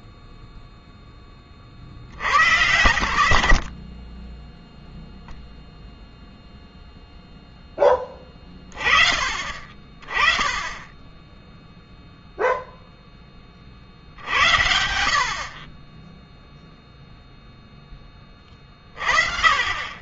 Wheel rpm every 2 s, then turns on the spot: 0, 90, 0, 0, 40, 10, 0, 40, 0, 30.
none